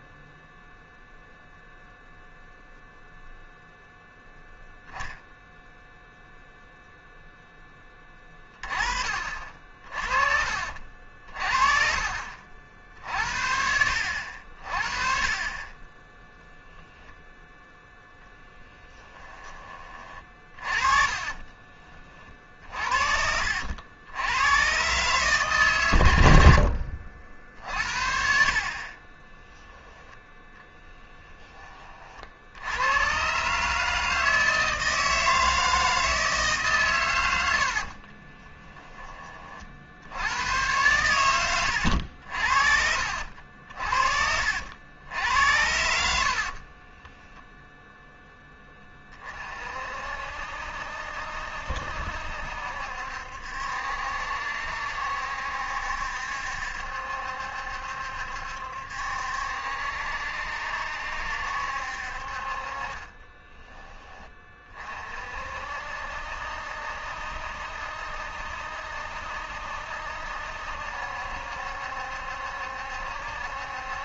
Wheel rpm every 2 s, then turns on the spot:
0, 0, 0, 0, 30, 50, 50, 50, 10, 10, 30, 60, 120, 70, 50, 20, 90, 160, 140, 20, 100, 50, 70, 40, 10, 60, 70, 70, 70, 70, 70, 40, 30, 70, 70, 70, 70.
18-22 26-32 38-40 42-44 46-48